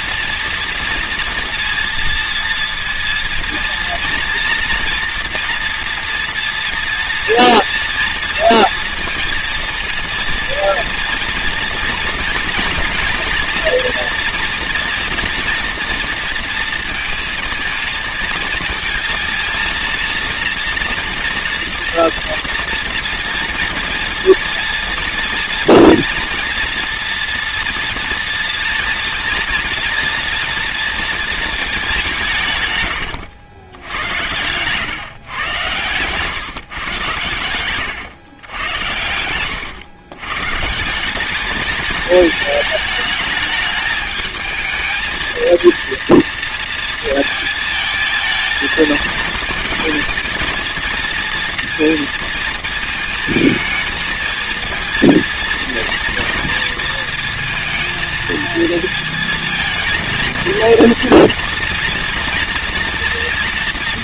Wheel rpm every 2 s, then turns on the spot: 230, 230, 240, 230, 230, 230, 230, 230, 230, 220, 230, 230, 240, 230, 230, 230, 140, 130, 130, 100, 150, 220, 220, 230, 220, 230, 230, 230, 230, 230, 230, 230.
36-38